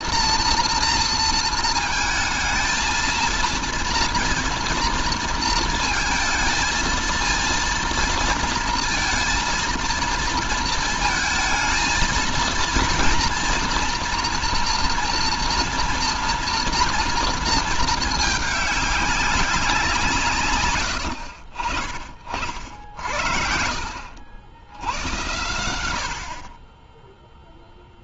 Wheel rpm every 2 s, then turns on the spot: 230, 220, 230, 220, 230, 230, 230, 230, 230, 210, 110, 40, 80, 60.
none